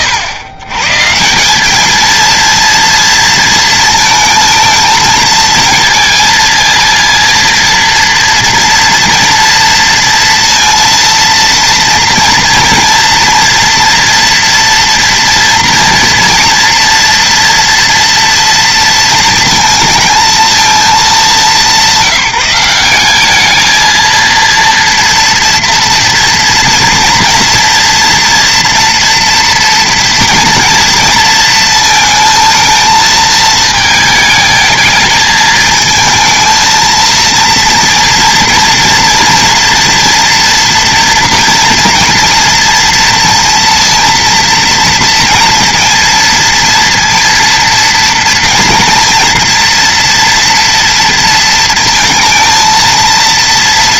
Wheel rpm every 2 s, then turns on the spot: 130, 230, 230, 230, 230, 230, 230, 230, 230, 230, 210, 190, 230, 240, 240, 230, 220, 220, 230, 230, 230, 230, 220, 230, 230, 230, 230.
none